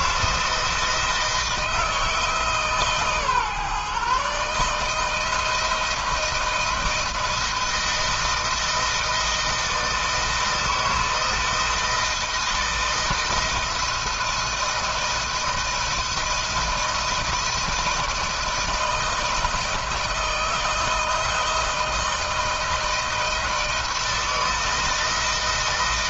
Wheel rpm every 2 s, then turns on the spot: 160, 140, 160, 160, 160, 160, 160, 160, 170, 160, 160, 160, 160.
none